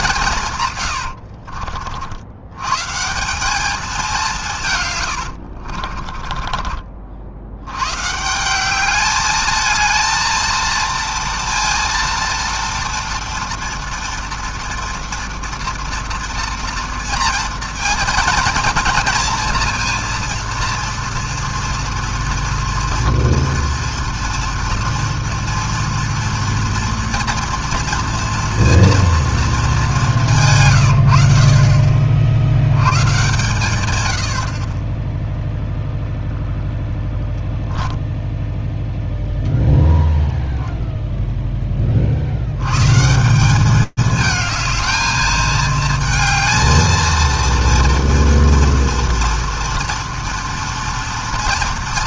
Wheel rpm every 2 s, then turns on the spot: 160, 90, 160, 30, 170, 230, 230, 230, 230, 230, 230, 230, 230, 230, 230, 150, 70, 50, 0, 0, 0, 90, 220, 220, 230, 230.
6-8